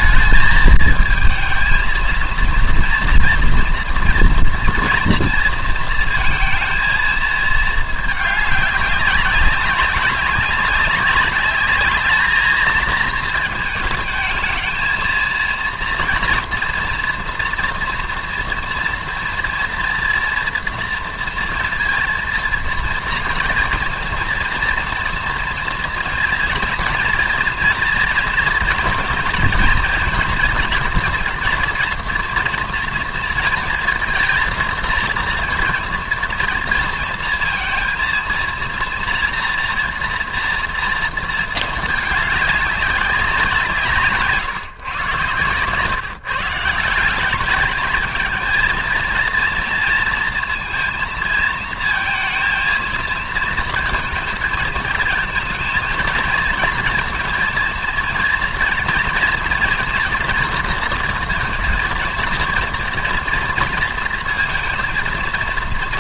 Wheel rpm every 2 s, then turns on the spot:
220, 230, 230, 230, 190, 190, 220, 220, 230, 240, 230, 230, 230, 230, 230, 230, 230, 230, 230, 230, 230, 200, 120, 170, 230, 230, 230, 230, 230, 230, 230, 230, 230.
none